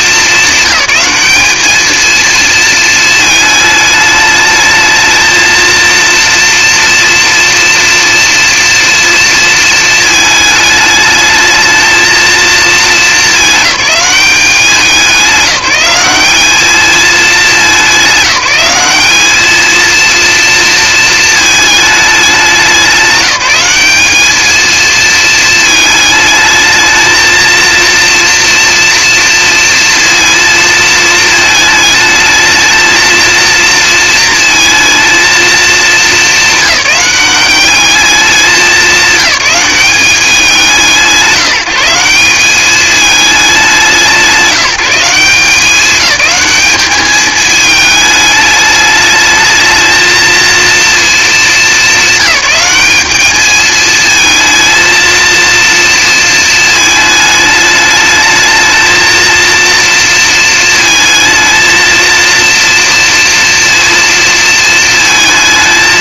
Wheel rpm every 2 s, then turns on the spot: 200, 230, 220, 230, 230, 220, 220, 190, 190, 190, 230, 200, 220, 220, 230, 230, 220, 220, 210, 210, 180, 190, 170, 210, 210, 230, 200, 230, 230, 220, 230, 230, 230.
none